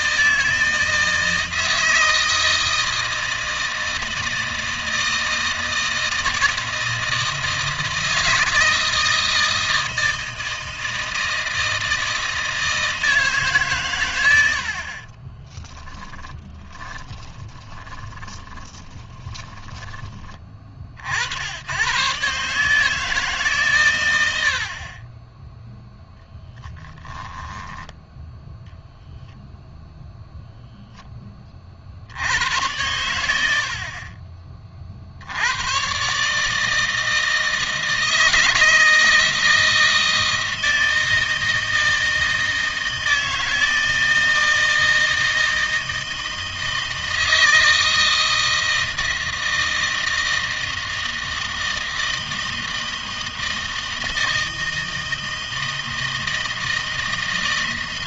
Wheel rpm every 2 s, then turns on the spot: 160, 160, 160, 160, 160, 160, 160, 60, 20, 10, 40, 150, 50, 10, 0, 0, 90, 40, 150, 160, 160, 160, 160, 160, 160, 160, 160, 160, 160.
14-20 26-28